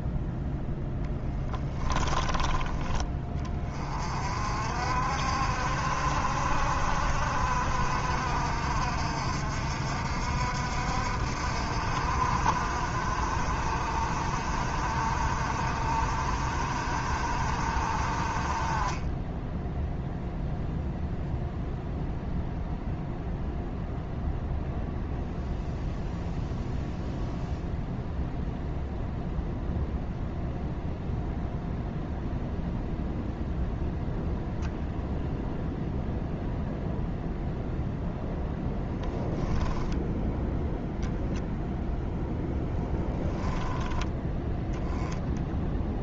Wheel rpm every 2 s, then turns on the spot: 10, 10, 50, 60, 60, 60, 50, 50, 50, 30, 0, 0, 0, 0, 0, 0, 0, 0, 0, 0, 0, 10, 10.
42-44